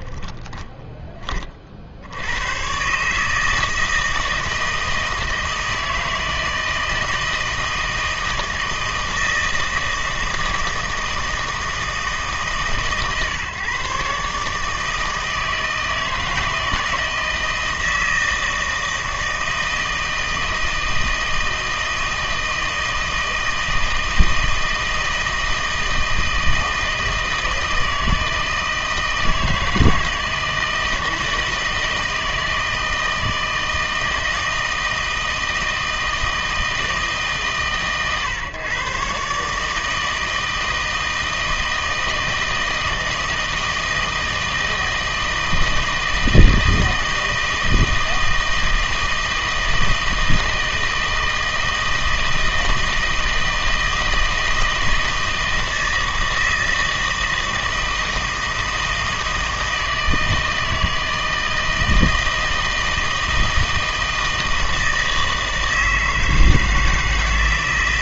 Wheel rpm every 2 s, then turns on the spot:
10, 120, 160, 160, 160, 160, 130, 150, 160, 160, 160, 160, 160, 160, 160, 160, 160, 160, 160, 130, 160, 160, 160, 160, 160, 160, 160, 160, 160, 160, 160, 160, 160, 160.
0-2